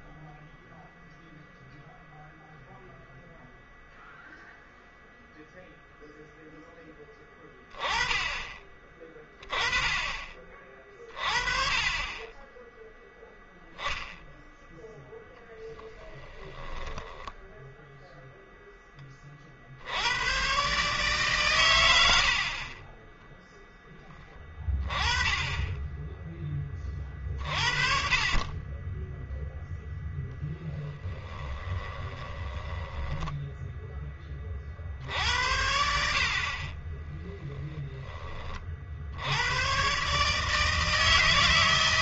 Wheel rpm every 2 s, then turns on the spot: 0, 0, 0, 10, 20, 30, 10, 0, 10, 10, 140, 40, 20, 30, 10, 10, 10, 50, 30, 40, 160.
16-18 30-34